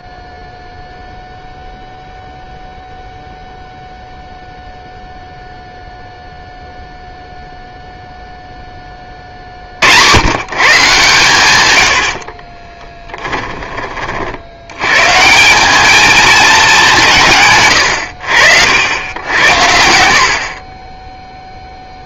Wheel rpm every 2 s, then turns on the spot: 0, 0, 0, 0, 10, 140, 30, 90, 200, 80, 40.
12-14